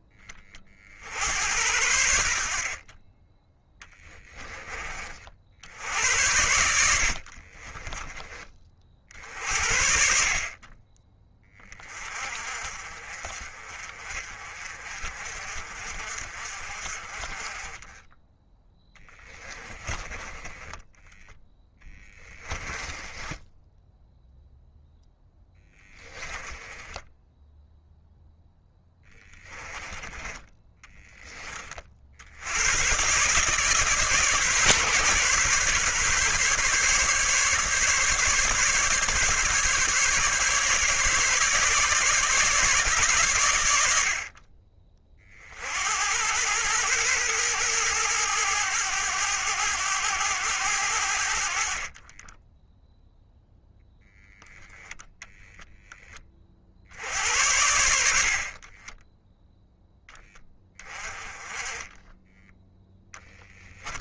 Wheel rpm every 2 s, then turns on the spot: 50, 40, 30, 70, 40, 20, 40, 40, 40, 10, 10, 20, 0, 10, 10, 10, 120, 140, 140, 140, 140, 140, 30, 110, 100, 90, 0, 0, 70, 20, 20, 0.
6-8 18-24 26-32